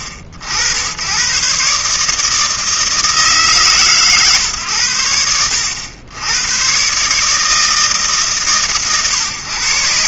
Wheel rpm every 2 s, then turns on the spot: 80, 160, 110, 120, 120.
none